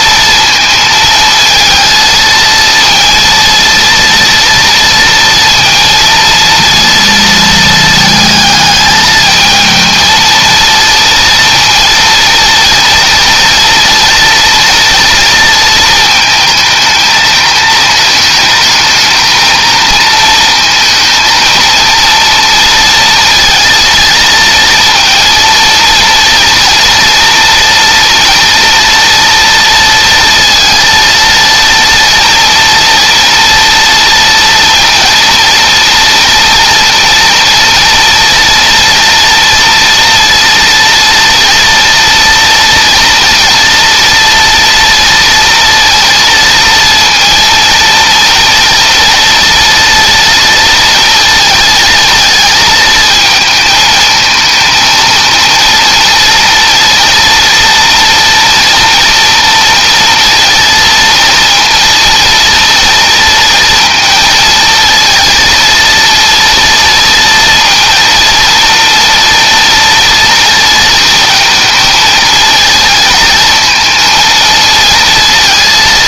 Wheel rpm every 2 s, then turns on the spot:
230, 230, 230, 230, 220, 230, 230, 230, 220, 210, 230, 230, 230, 230, 230, 230, 230, 230, 230, 230, 230, 230, 230, 230, 230, 230, 220, 230, 230, 230, 230, 230, 230, 230, 240, 220, 220, 230.
none